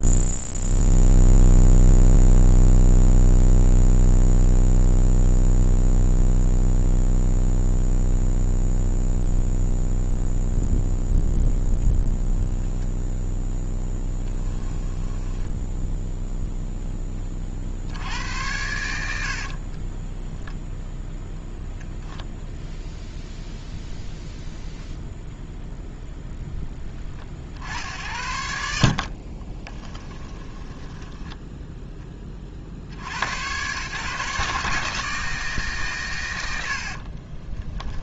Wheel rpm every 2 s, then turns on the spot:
0, 0, 0, 0, 0, 0, 0, 10, 0, 90, 0, 0, 0, 10, 70, 10, 60, 150, 90.
14-16 18-20 28-32 36-38